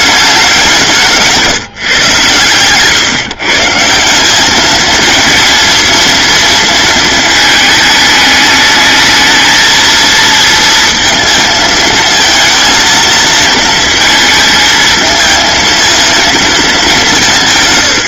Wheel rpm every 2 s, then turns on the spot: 190, 120, 200, 230, 210, 230, 230, 220, 220.
none